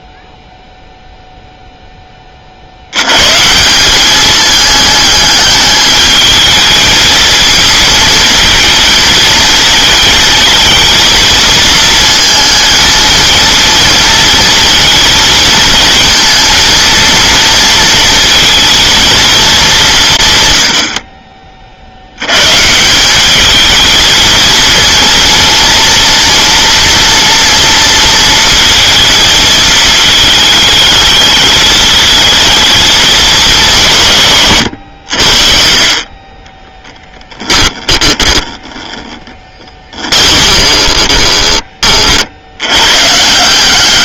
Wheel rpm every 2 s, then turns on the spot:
0, 70, 210, 220, 220, 220, 220, 220, 230, 230, 100, 160, 230, 230, 230, 210, 220, 110, 10, 20, 30, 100.
36-38 40-42